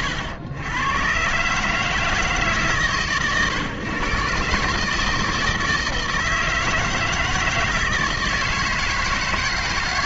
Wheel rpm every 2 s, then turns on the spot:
100, 140, 140, 160, 160.
none